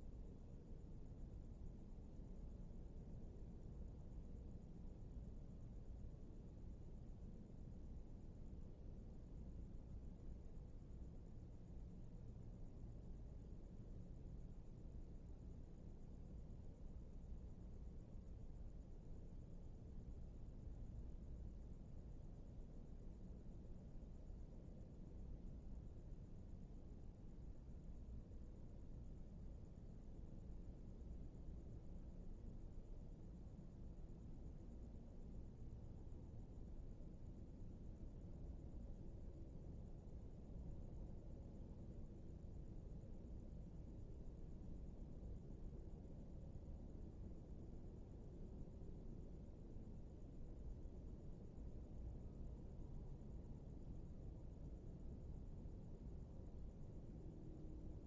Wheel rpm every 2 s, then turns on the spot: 0, 0, 0, 0, 0, 0, 0, 0, 0, 0, 0, 0, 0, 0, 0, 0, 0, 0, 0, 0, 0, 0, 0, 0, 0, 0, 0, 0, 0.
none